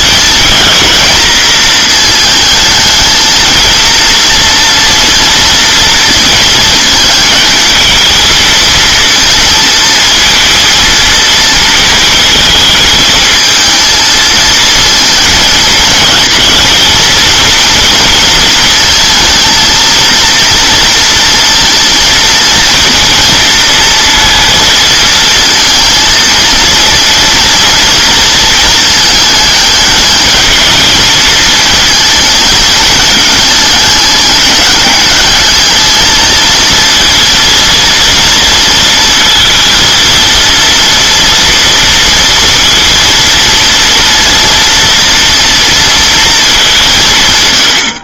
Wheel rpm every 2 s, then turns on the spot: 220, 220, 230, 220, 220, 230, 220, 230, 230, 230, 230, 230, 230, 230, 230, 220, 220, 200, 220, 230, 230, 230, 230, 220.
none